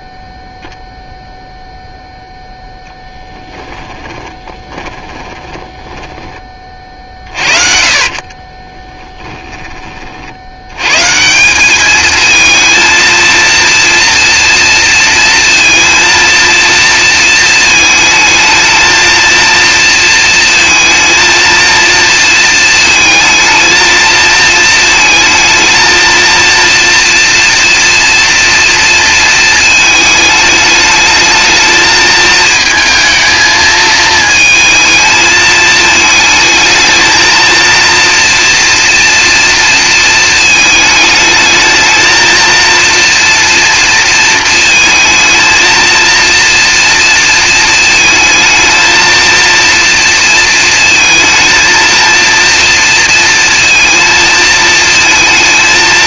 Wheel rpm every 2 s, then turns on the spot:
0, 10, 30, 40, 20, 110, 230, 230, 230, 230, 230, 220, 230, 230, 230, 210, 230, 220, 220, 230, 220, 230, 220, 230, 220, 220, 230, 230.
2-6 8-10